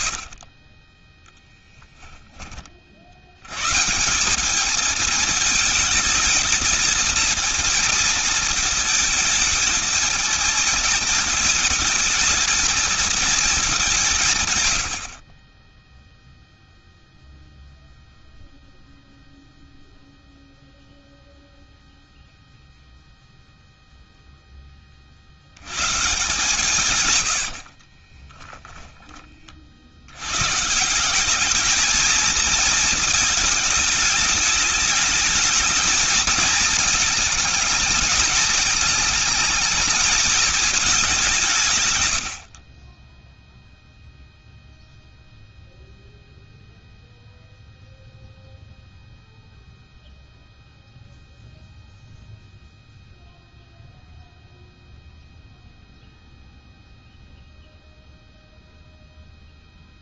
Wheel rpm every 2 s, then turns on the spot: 20, 50, 210, 220, 220, 220, 220, 100, 0, 0, 0, 0, 20, 130, 10, 150, 220, 210, 220, 220, 210, 50, 0, 0, 0, 0, 0, 0, 0, 0.
28-30